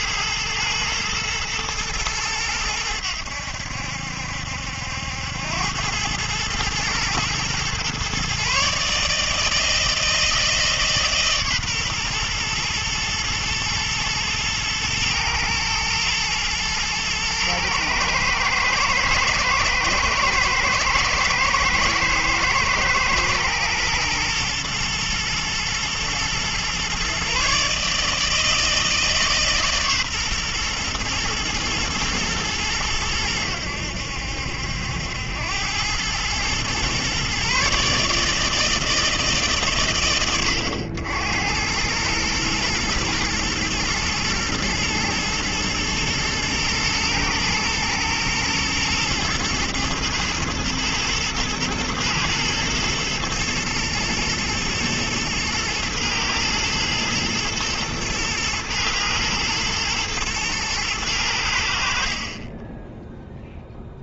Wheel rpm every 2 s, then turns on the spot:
110, 100, 70, 110, 140, 160, 120, 120, 120, 110, 110, 110, 120, 120, 160, 130, 110, 80, 110, 160, 100, 110, 110, 110, 110, 110, 110, 120, 120, 110, 110, 20.
none